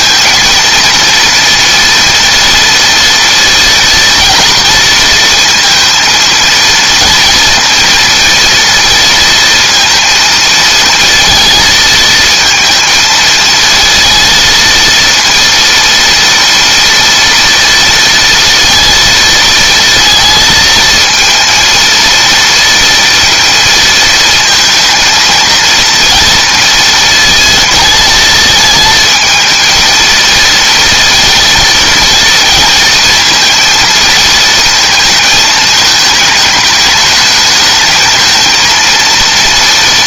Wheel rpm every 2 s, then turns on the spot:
230, 230, 220, 230, 230, 230, 230, 230, 230, 230, 220, 230, 220, 230, 220, 230, 230, 230, 210, 230.
none